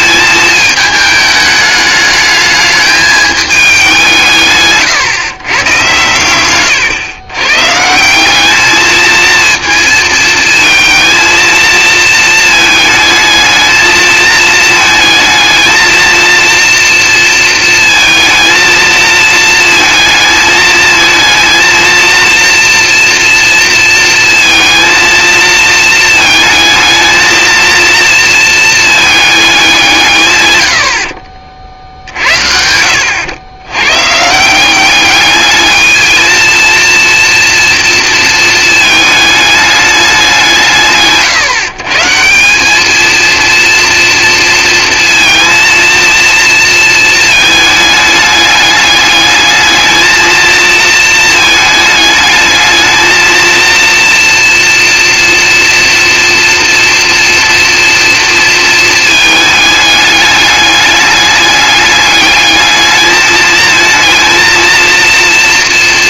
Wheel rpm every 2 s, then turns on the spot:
220, 210, 150, 110, 200, 230, 220, 220, 230, 230, 220, 230, 230, 220, 230, 120, 60, 170, 230, 230, 180, 190, 230, 230, 210, 230, 220, 230, 230, 230, 210, 210, 230.
6-8